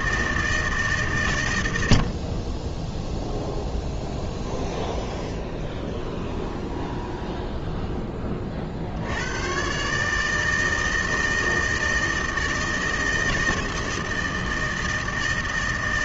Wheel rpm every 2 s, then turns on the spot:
150, 20, 20, 10, 60, 160, 160, 160.
4-8